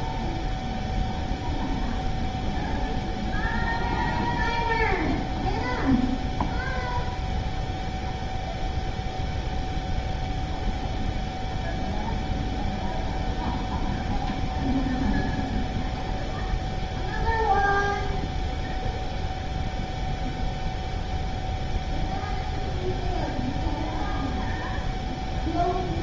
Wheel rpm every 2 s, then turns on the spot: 0, 0, 0, 0, 0, 0, 0, 0, 0, 0, 0, 0, 0.
none